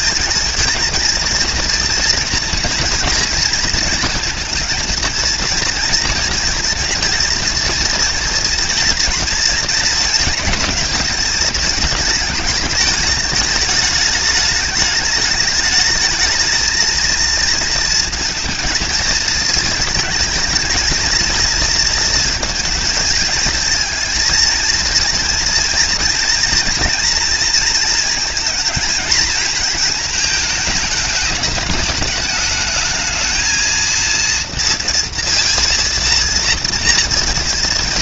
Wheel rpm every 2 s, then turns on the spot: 220, 230, 230, 230, 230, 220, 220, 210, 220, 220, 220, 230, 230, 230, 220, 220, 210, 230, 230.
none